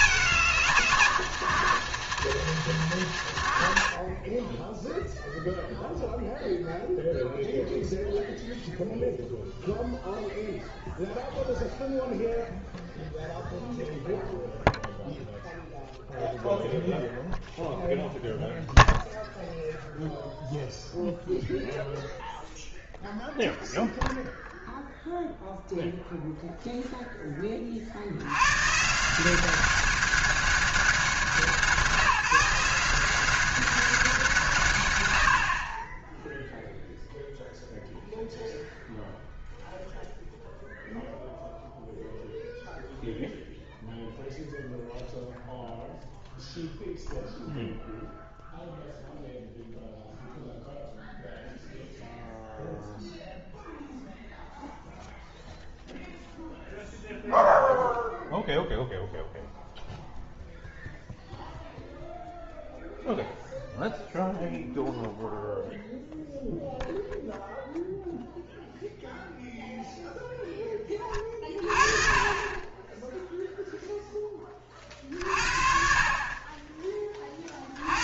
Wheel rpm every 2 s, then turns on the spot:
140, 130, 10, 0, 0, 0, 0, 0, 0, 0, 0, 0, 0, 0, 150, 190, 180, 130, 0, 0, 0, 0, 0, 0, 0, 0, 0, 0, 0, 0, 0, 0, 0, 0, 0, 20, 20, 40, 30.
none